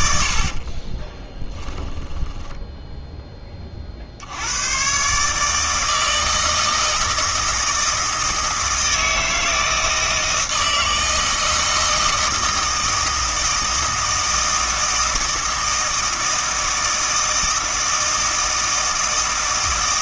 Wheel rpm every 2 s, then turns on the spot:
40, 10, 110, 160, 160, 160, 160, 160, 160, 160.
0-2